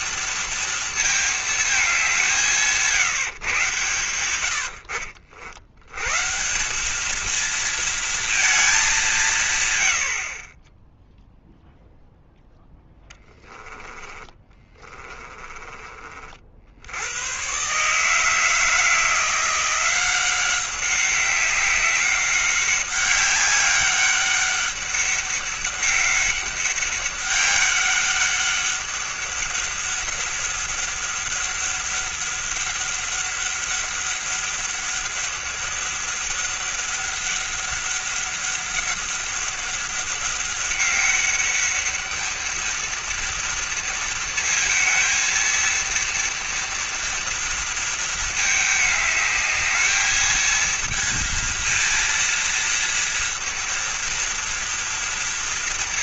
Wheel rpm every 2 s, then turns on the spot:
230, 170, 90, 190, 210, 30, 10, 20, 70, 160, 190, 200, 200, 200, 200, 200, 200, 200, 200, 200, 200, 230, 220, 230, 210, 220, 230, 230.
4-6 12-16